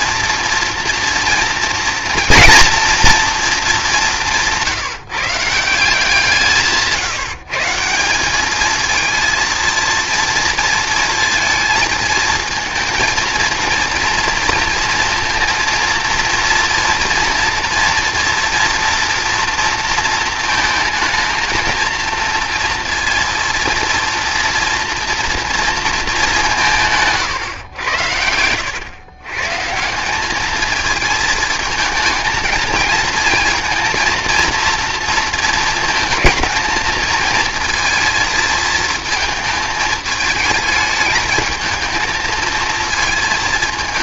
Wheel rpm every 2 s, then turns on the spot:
230, 230, 150, 160, 220, 230, 220, 230, 230, 230, 220, 230, 240, 160, 110, 220, 230, 230, 220, 220, 220, 220.
none